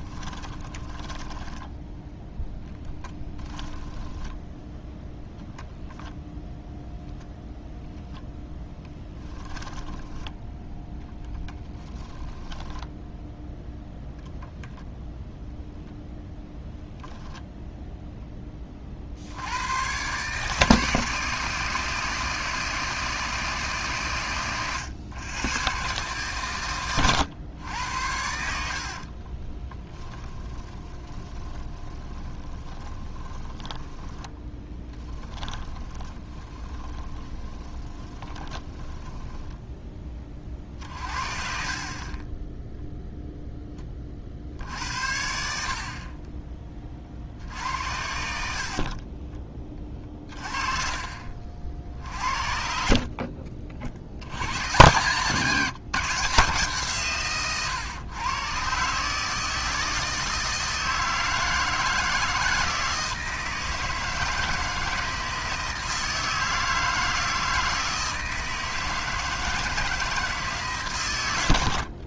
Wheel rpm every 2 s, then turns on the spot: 10, 10, 0, 0, 20, 10, 10, 0, 0, 40, 160, 160, 120, 120, 50, 20, 20, 10, 20, 10, 50, 0, 70, 30, 40, 30, 50, 120, 150, 140, 160, 160, 160, 160, 160, 140.
0-4 8-14 28-40 48-54